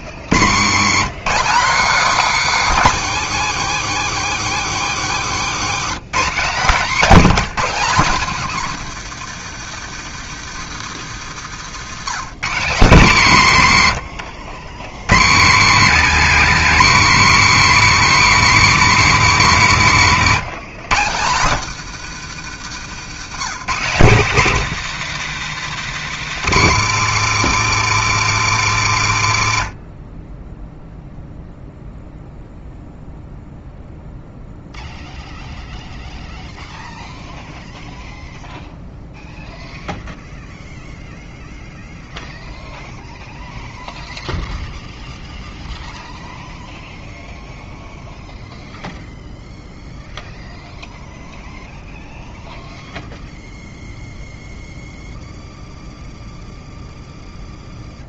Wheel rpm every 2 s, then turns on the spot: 70, 280, 260, 230, 190, 160, 170, 80, 200, 210, 160, 160, 180, 160, 140, 10, 0, 0, 0, 0, 0, 0, 0, 0, 0, 0, 0, 0, 0.
22-24